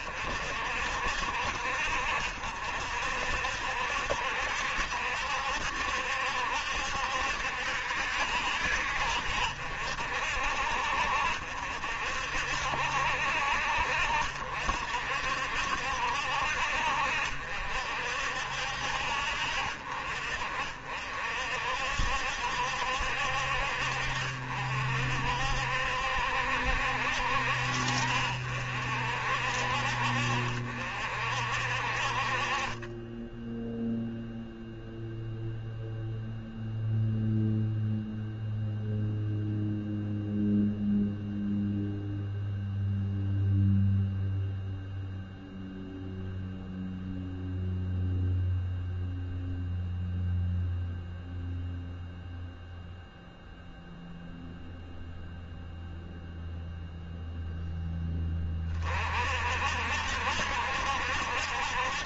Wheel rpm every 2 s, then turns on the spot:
60, 60, 70, 70, 60, 60, 60, 60, 60, 60, 50, 70, 60, 60, 60, 60, 20, 0, 0, 0, 0, 0, 0, 0, 0, 0, 0, 0, 0, 40, 70.
none